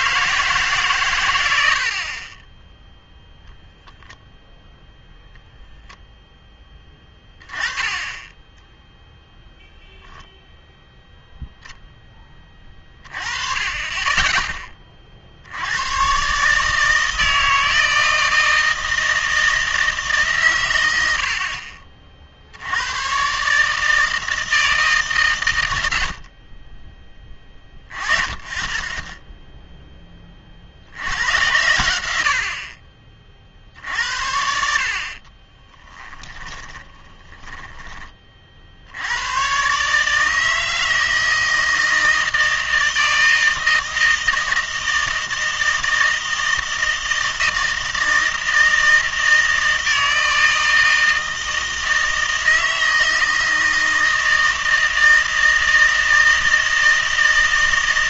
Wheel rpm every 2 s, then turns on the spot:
140, 0, 0, 10, 10, 0, 30, 20, 150, 160, 110, 80, 160, 30, 20, 60, 50, 60, 20, 60, 160, 160, 160, 160, 160, 160, 160, 160, 160.
36-38